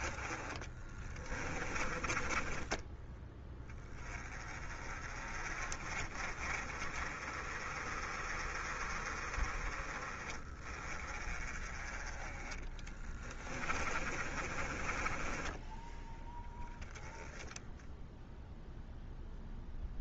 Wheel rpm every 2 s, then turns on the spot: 20, 20, 30, 30, 30, 30, 20, 20, 10, 0.
0-2 12-16